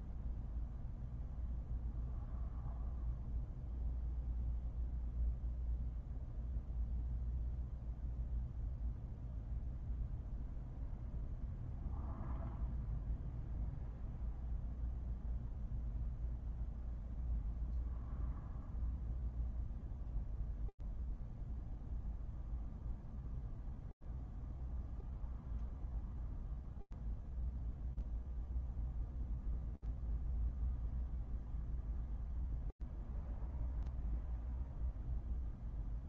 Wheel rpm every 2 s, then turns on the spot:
0, 0, 0, 0, 0, 0, 0, 0, 0, 0, 0, 0, 0, 0, 0, 0, 0, 0.
none